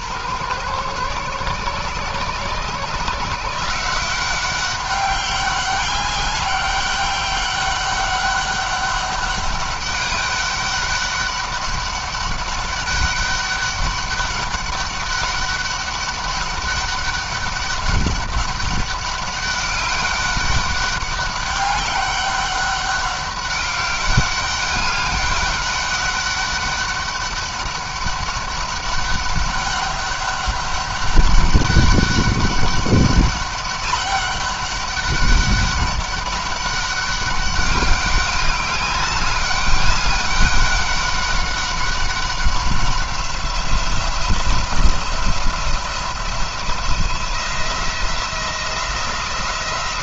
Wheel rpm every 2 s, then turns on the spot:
120, 140, 190, 200, 200, 200, 200, 200, 200, 200, 200, 200, 200, 200, 200, 200, 200, 200, 200, 200, 190, 190, 170, 170, 170.
none